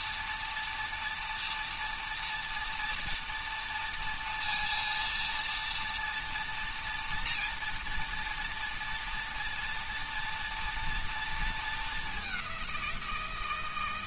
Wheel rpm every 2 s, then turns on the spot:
230, 230, 230, 230, 230, 230, 180.
none